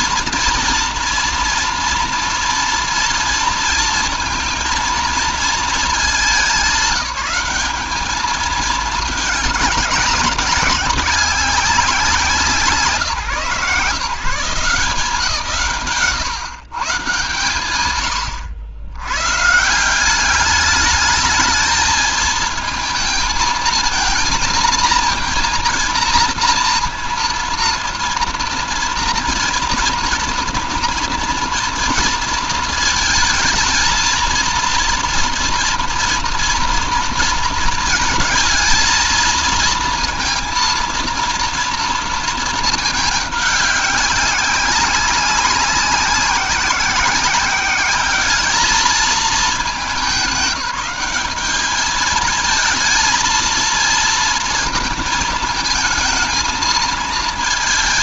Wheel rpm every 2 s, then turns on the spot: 230, 230, 230, 210, 220, 190, 160, 180, 140, 90, 210, 220, 230, 230, 230, 240, 230, 230, 230, 220, 230, 220, 190, 190, 220, 200, 230, 230, 220.
none